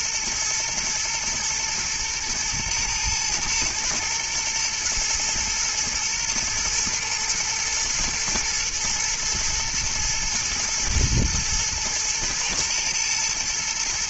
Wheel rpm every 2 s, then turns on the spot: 120, 120, 120, 120, 120, 120, 120.
none